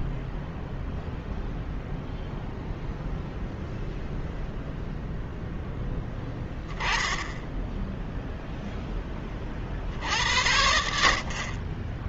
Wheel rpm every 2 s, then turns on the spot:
0, 0, 0, 10, 0, 80.
none